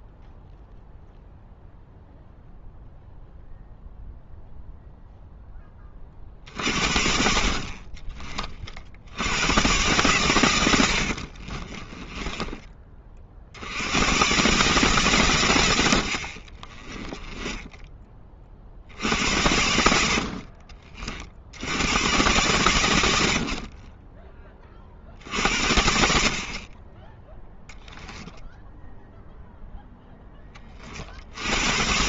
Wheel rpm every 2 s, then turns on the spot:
0, 0, 0, 60, 60, 70, 30, 140, 20, 50, 40, 100, 40, 20, 0, 40.
16-18